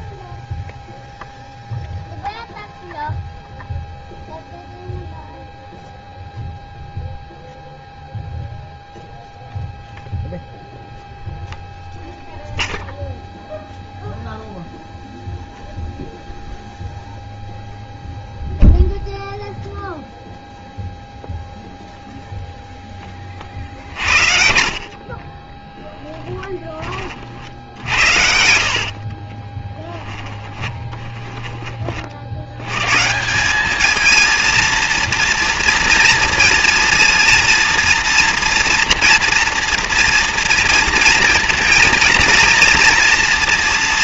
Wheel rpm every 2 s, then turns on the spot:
0, 0, 0, 0, 0, 0, 0, 0, 0, 0, 0, 40, 10, 60, 10, 30, 200, 230, 230, 230, 230, 230.
22-30